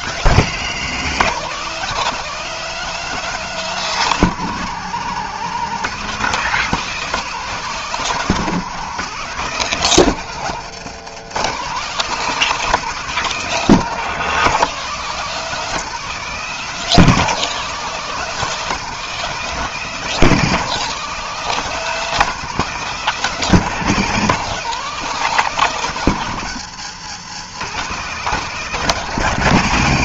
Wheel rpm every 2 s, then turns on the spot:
170, 210, 180, 200, 190, 170, 200, 190, 190, 190, 190, 200, 190, 150, 190.
none